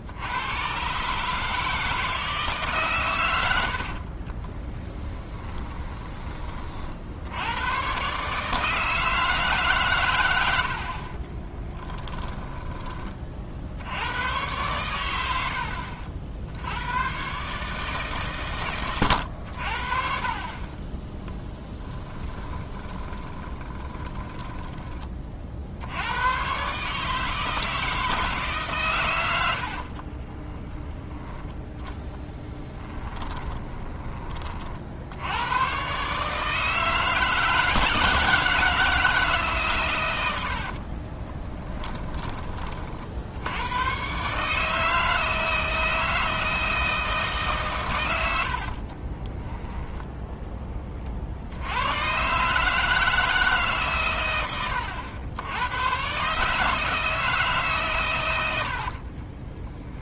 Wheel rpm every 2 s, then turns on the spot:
130, 140, 20, 50, 160, 50, 30, 100, 100, 110, 30, 20, 20, 150, 130, 10, 10, 60, 160, 160, 40, 40, 150, 160, 40, 20, 150, 90, 160, 60.
4-6 20-24 30-34 40-42 48-50 58-60